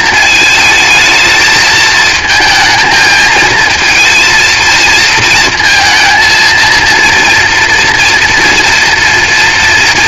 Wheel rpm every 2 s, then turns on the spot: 220, 220, 220, 230, 230.
none